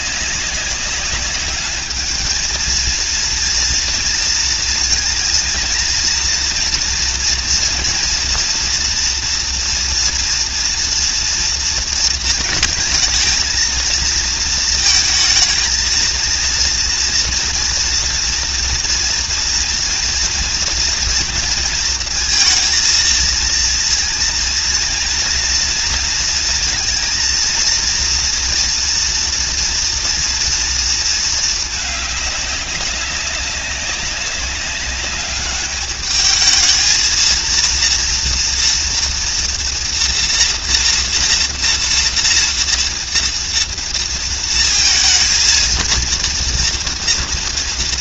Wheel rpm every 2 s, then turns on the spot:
200, 220, 230, 230, 230, 230, 220, 220, 230, 230, 230, 230, 230, 230, 240, 230, 200, 200, 220, 230, 230, 230, 230, 230.
none